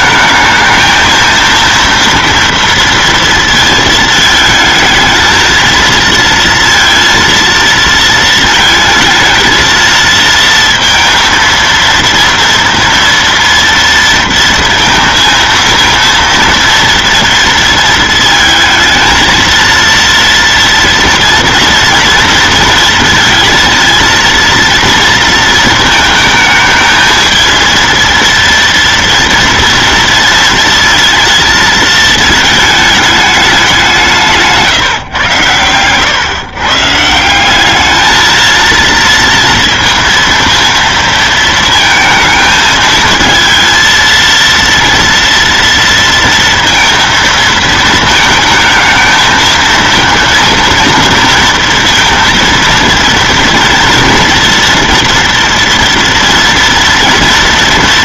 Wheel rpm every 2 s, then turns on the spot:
220, 230, 220, 230, 220, 230, 230, 230, 230, 230, 230, 230, 230, 220, 230, 230, 220, 140, 150, 230, 230, 220, 230, 230, 220, 230, 230, 230, 230.
none